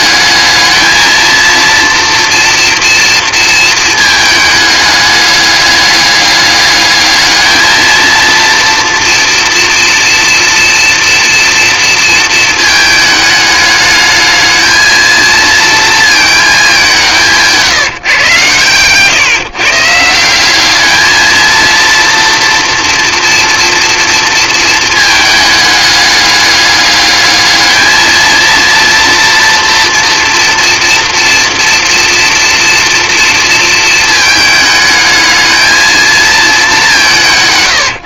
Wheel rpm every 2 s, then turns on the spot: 220, 230, 220, 210, 230, 230, 220, 220, 190, 120, 210, 230, 220, 210, 230, 230, 230, 220, 200.
none